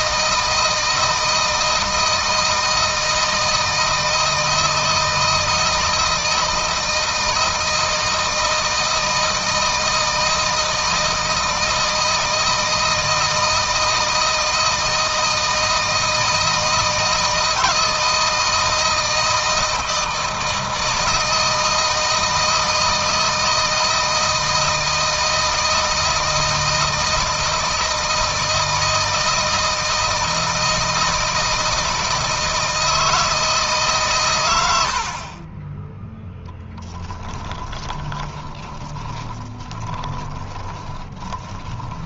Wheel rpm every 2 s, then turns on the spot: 160, 160, 160, 160, 160, 160, 160, 160, 160, 160, 160, 160, 160, 160, 160, 160, 160, 80, 10, 20, 20.
36-42